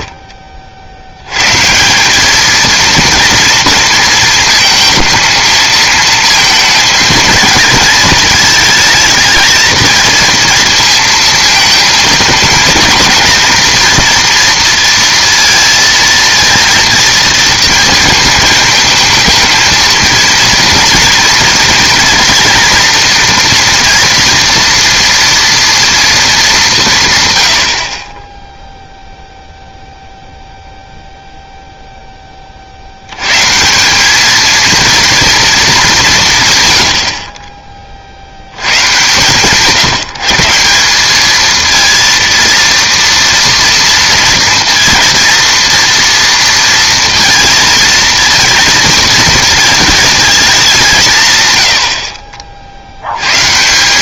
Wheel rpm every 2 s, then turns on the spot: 20, 200, 220, 230, 220, 230, 230, 230, 230, 220, 230, 240, 230, 220, 20, 0, 60, 230, 70, 100, 190, 230, 230, 230, 220, 180, 70.
none